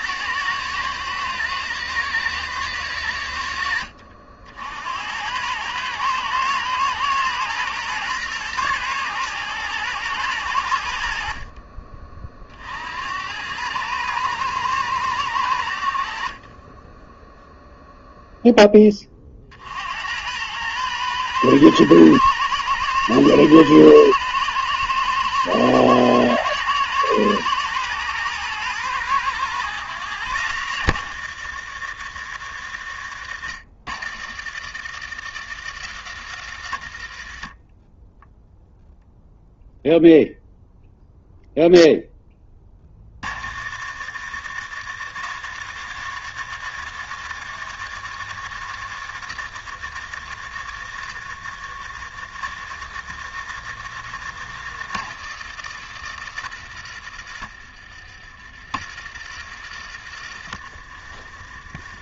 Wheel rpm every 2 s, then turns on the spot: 110, 110, 70, 110, 120, 90, 50, 110, 30, 10, 100, 110, 110, 110, 110, 100, 70, 80, 70, 0, 0, 20, 80, 100, 90, 70, 70, 80, 70, 50, 40.
none